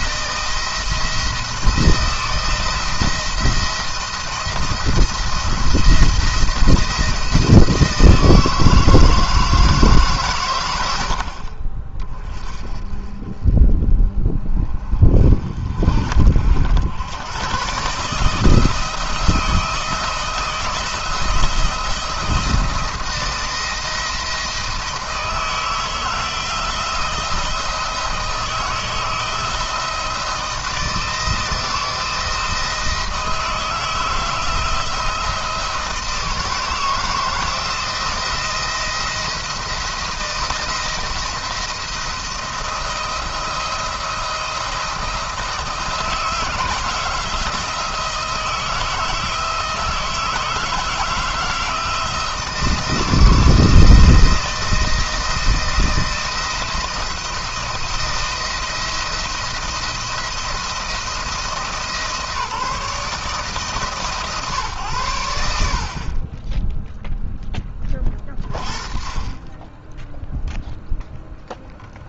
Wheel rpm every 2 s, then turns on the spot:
170, 170, 170, 170, 160, 110, 30, 30, 70, 160, 170, 170, 160, 170, 160, 160, 160, 160, 160, 170, 170, 170, 160, 160, 160, 170, 160, 160, 170, 170, 170, 160, 130, 10, 30, 0.
none